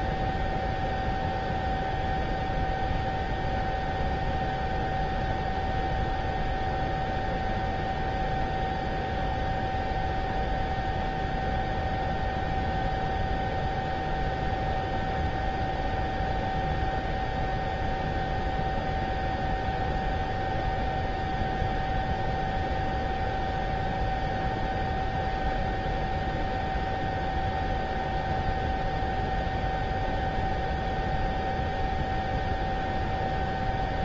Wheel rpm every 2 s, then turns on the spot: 0, 0, 0, 0, 0, 0, 0, 0, 0, 0, 0, 0, 0, 0, 0, 0, 0.
none